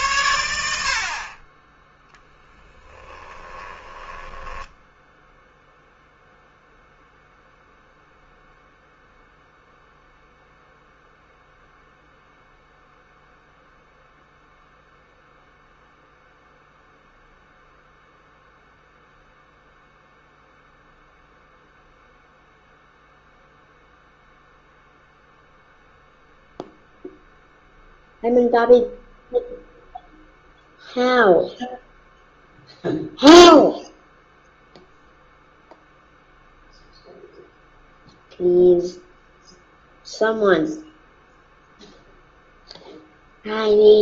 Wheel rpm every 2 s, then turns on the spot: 80, 10, 10, 0, 0, 0, 0, 0, 0, 0, 0, 0, 0, 0, 0, 0, 0, 0, 0, 0, 0, 0.
2-6